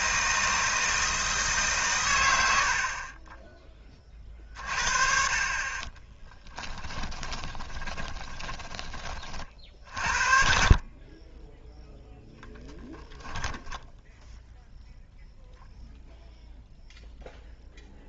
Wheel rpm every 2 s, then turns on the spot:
160, 70, 50, 20, 20, 40, 0, 0, 0.
6-10